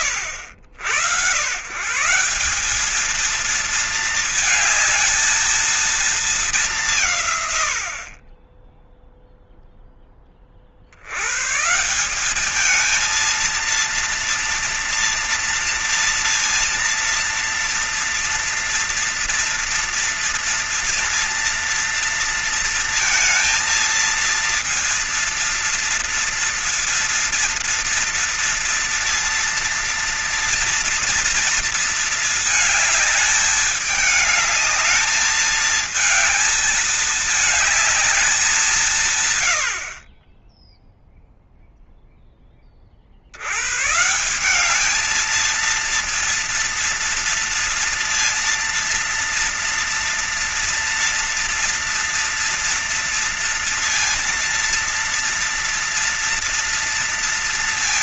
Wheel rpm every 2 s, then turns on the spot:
100, 190, 220, 200, 20, 50, 210, 230, 230, 240, 230, 230, 230, 230, 230, 230, 220, 210, 220, 190, 20, 30, 200, 230, 230, 240, 230, 230, 230.
none